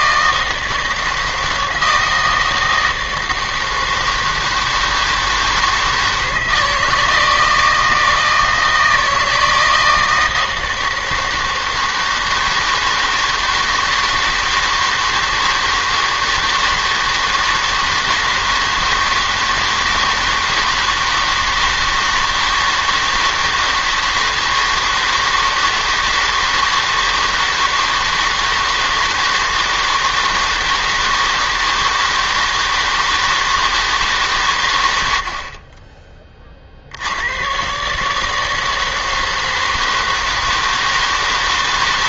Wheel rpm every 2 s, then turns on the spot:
160, 160, 160, 160, 160, 160, 160, 160, 160, 160, 160, 160, 160, 160, 160, 160, 160, 120, 50, 160, 160.
none